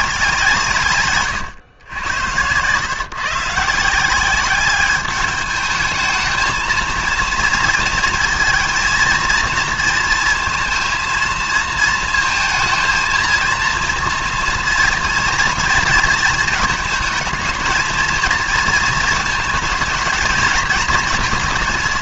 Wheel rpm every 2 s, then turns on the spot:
160, 120, 200, 220, 230, 230, 230, 230, 230, 230, 220.
none